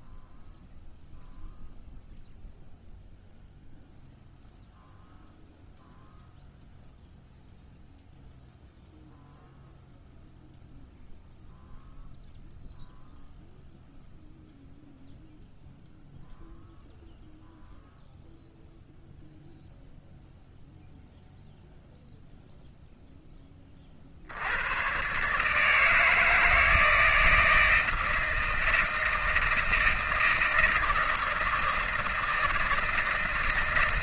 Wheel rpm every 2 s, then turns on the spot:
0, 0, 0, 0, 0, 0, 0, 0, 0, 0, 0, 0, 80, 160, 160, 160, 160.
none